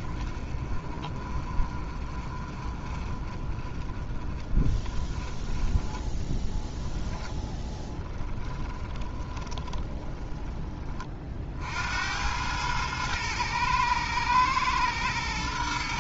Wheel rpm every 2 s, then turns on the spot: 30, 30, 20, 10, 20, 20, 110, 110.
6-10